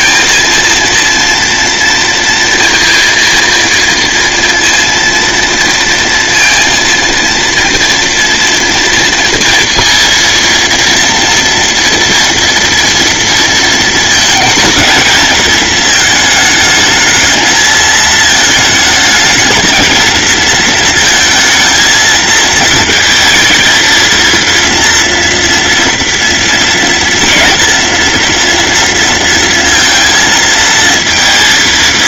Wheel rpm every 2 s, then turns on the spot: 230, 230, 230, 230, 230, 230, 230, 220, 220, 220, 230, 230, 230, 230, 230, 230.
none